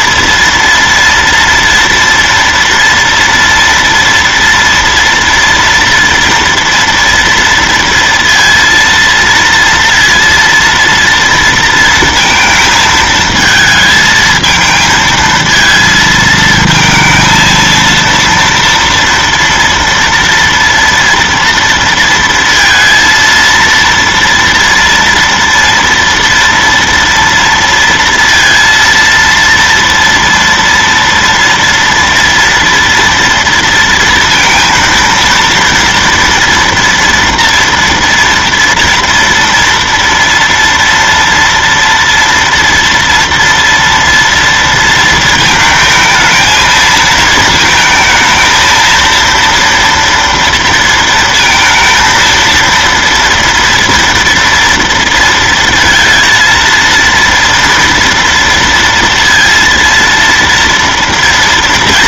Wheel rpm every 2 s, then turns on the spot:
240, 230, 240, 230, 230, 230, 230, 220, 220, 240, 230, 230, 230, 230, 230, 230, 230, 230, 230, 230, 230, 230, 230, 220, 220, 230, 230, 230, 230, 230, 230.
none